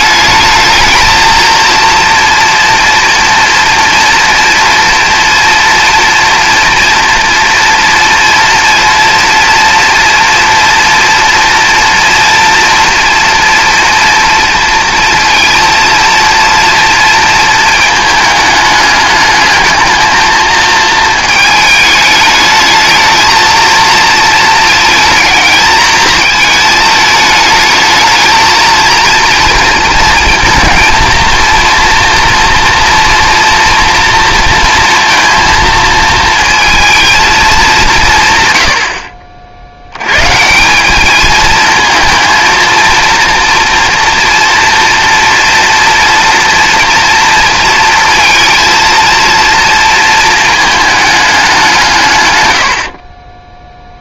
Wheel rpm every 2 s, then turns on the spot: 220, 230, 240, 230, 240, 230, 230, 230, 230, 210, 220, 210, 220, 220, 230, 230, 230, 230, 230, 80, 180, 230, 240, 230, 230, 220, 70.
none